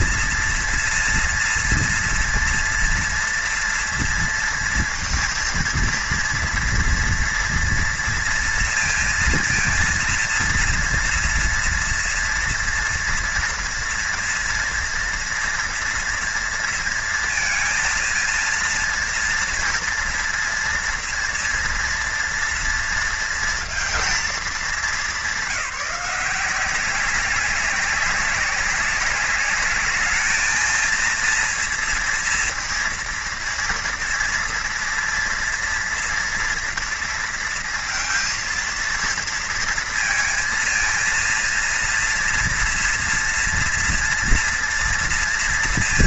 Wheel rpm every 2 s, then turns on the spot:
230, 230, 230, 230, 230, 230, 230, 230, 230, 230, 230, 230, 190, 190, 200, 230, 230, 230, 230, 230, 230, 230, 230.
none